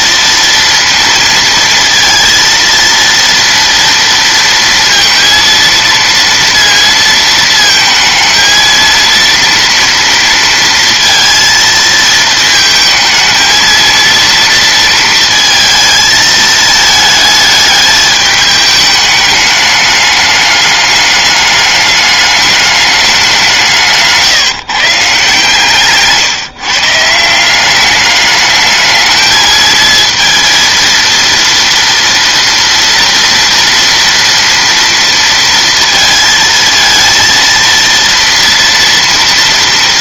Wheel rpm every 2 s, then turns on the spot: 230, 230, 230, 230, 230, 230, 220, 230, 220, 210, 210, 210, 150, 160, 210, 230, 230, 230, 230, 230.
none